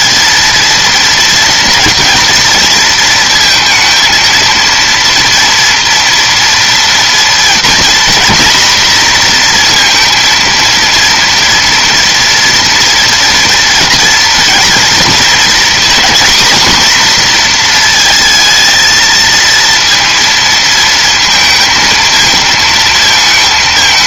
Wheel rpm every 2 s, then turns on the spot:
230, 230, 230, 240, 240, 230, 230, 230, 240, 220, 230, 220.
none